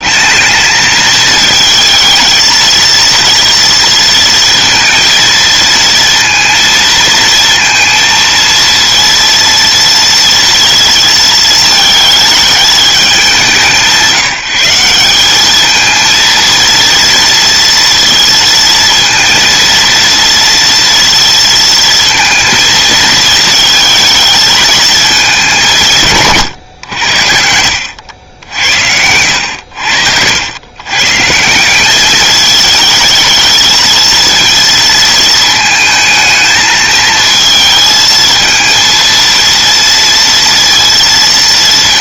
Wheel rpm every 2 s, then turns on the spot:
220, 230, 230, 230, 230, 230, 200, 190, 230, 230, 230, 220, 220, 80, 80, 150, 220, 230, 220, 230, 230.
none